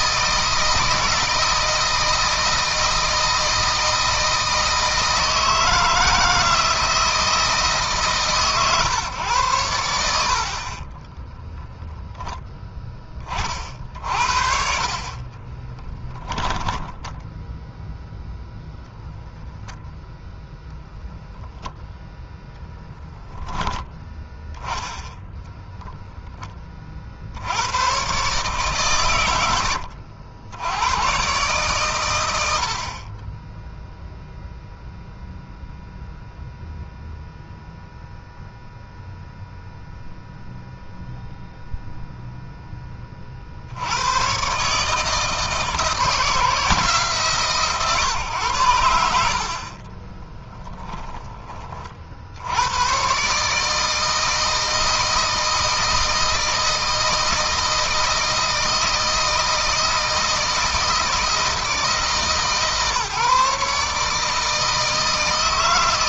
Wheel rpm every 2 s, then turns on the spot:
160, 160, 160, 160, 130, 30, 20, 50, 0, 0, 0, 10, 10, 40, 130, 110, 50, 0, 0, 0, 0, 20, 150, 160, 90, 10, 100, 160, 160, 160, 160, 150, 160.
10-12 14-16 24-26 50-52